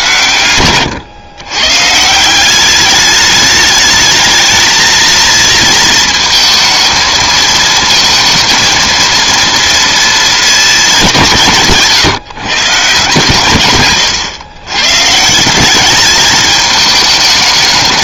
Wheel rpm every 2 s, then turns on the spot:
120, 190, 220, 230, 220, 220, 140, 130, 220.
0-2